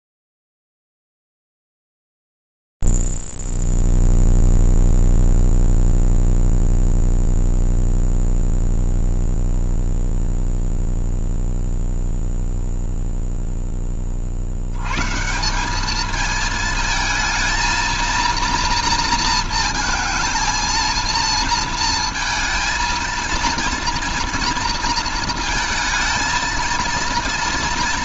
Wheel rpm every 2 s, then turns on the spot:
0, 0, 0, 0, 0, 0, 0, 40, 210, 230, 230, 230, 230, 230.
none